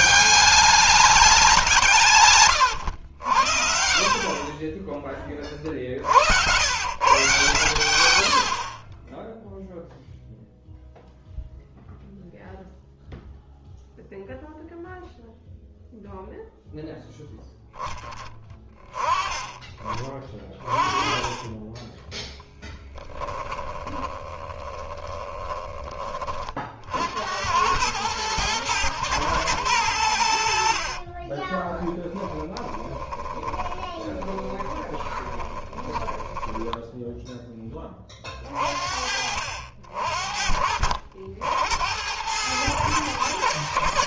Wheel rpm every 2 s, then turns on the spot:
200, 130, 30, 80, 60, 0, 0, 0, 0, 20, 30, 10, 20, 40, 110, 80, 10, 20, 10, 40, 50, 100.
2-6 22-26 30-36